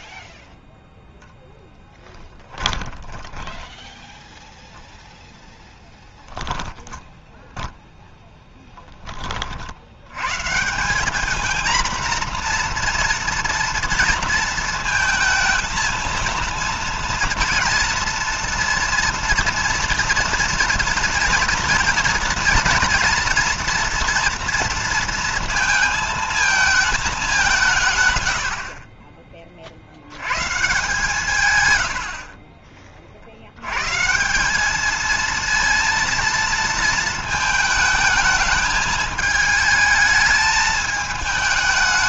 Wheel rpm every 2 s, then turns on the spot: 0, 20, 0, 10, 10, 160, 240, 230, 230, 240, 230, 230, 230, 220, 60, 140, 40, 190, 230, 220, 220.
2-4 6-8